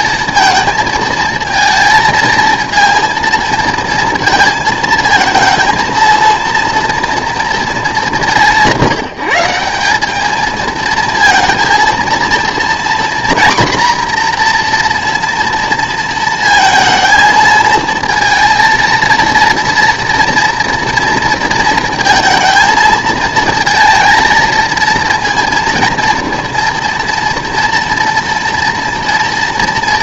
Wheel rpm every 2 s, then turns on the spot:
220, 230, 230, 230, 180, 220, 230, 240, 220, 230, 230, 220, 230, 230, 230.
none